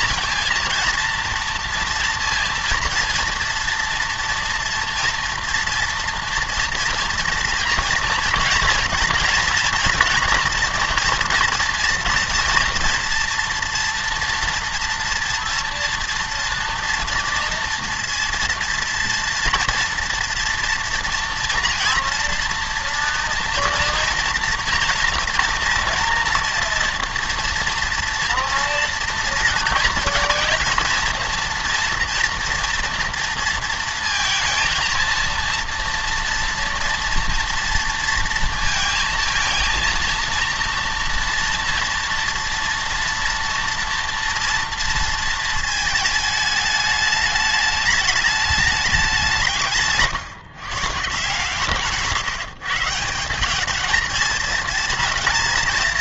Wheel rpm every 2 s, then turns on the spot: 230, 230, 240, 230, 230, 230, 230, 230, 240, 230, 240, 240, 230, 230, 230, 220, 230, 230, 230, 230, 230, 230, 230, 210, 210, 150, 160, 230.
none